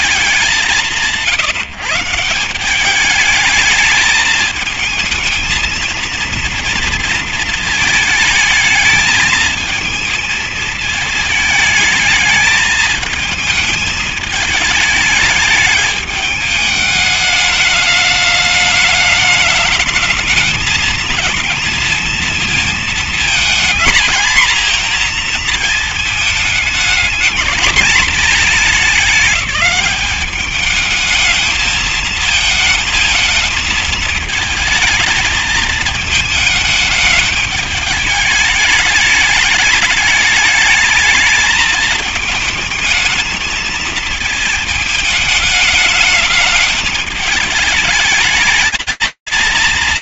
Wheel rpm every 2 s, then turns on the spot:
190, 180, 220, 230, 220, 220, 220, 220, 210, 210, 230, 230, 240, 220, 210, 210, 220, 220, 220, 210, 220, 220, 220, 210, 220.
none